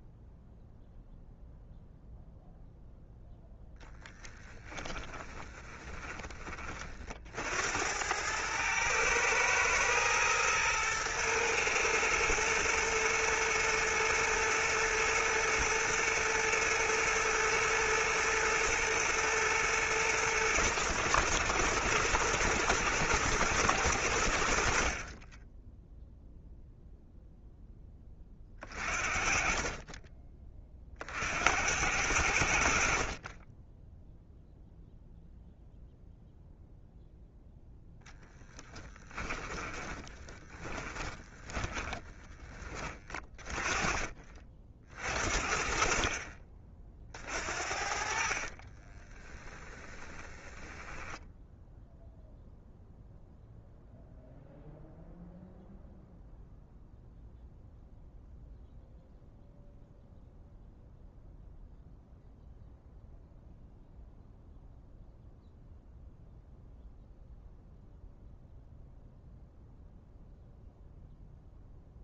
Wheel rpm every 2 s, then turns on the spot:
0, 0, 10, 40, 110, 120, 110, 110, 120, 110, 120, 110, 40, 0, 30, 50, 50, 0, 0, 20, 20, 30, 50, 40, 30, 10, 0, 0, 0, 0, 0, 0, 0, 0, 0, 0.
4-6 24-26 38-42 48-52